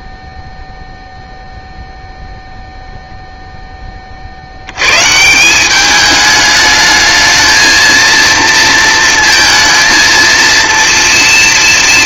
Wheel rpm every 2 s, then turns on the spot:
0, 0, 120, 220, 220, 230.
none